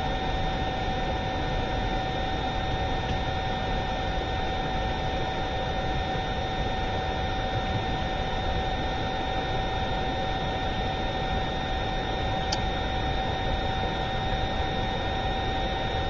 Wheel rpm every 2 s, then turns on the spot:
0, 0, 0, 0, 0, 0, 0, 0.
none